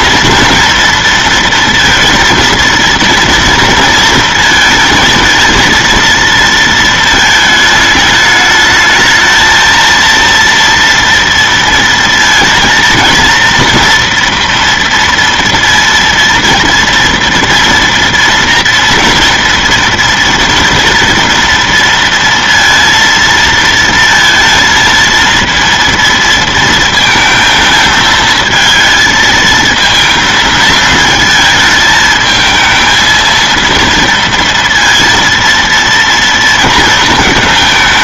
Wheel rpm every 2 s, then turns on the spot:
230, 230, 220, 230, 220, 230, 230, 230, 230, 230, 230, 230, 230, 230, 220, 230, 220, 230, 230.
none